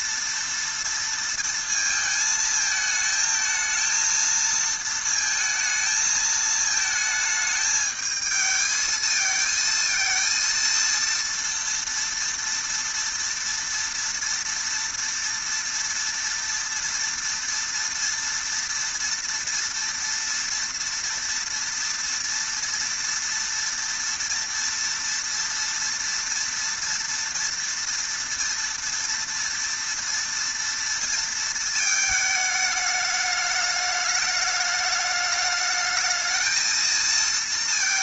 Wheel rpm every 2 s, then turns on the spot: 230, 220, 230, 220, 220, 230, 230, 230, 230, 230, 230, 230, 230, 230, 230, 230, 210, 210, 220.
none